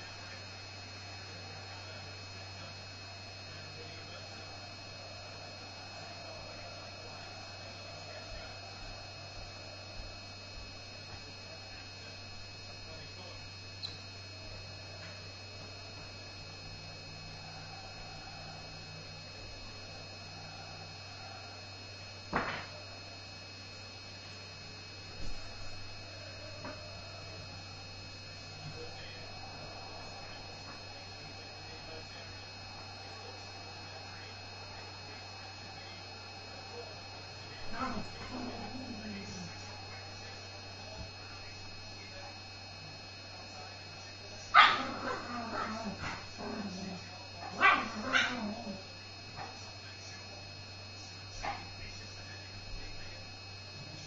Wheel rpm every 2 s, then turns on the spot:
0, 0, 0, 0, 0, 0, 0, 0, 0, 0, 0, 0, 0, 0, 0, 0, 0, 0, 0, 0, 0, 0, 0, 0, 0, 0, 0.
none